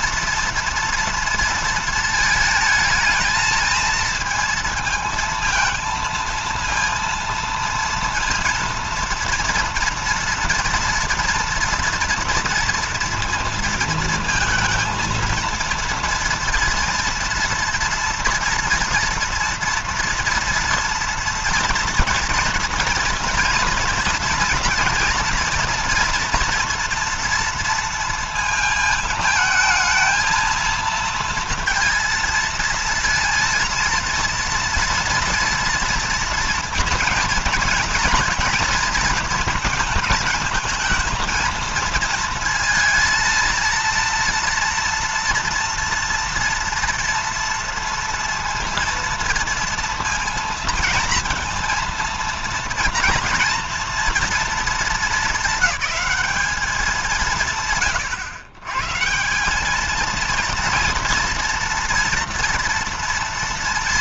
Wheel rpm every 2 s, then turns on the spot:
230, 220, 230, 230, 230, 230, 230, 230, 230, 230, 230, 240, 230, 240, 220, 230, 230, 230, 230, 230, 220, 230, 230, 230, 230, 230, 240, 220, 180, 160, 230, 230.
none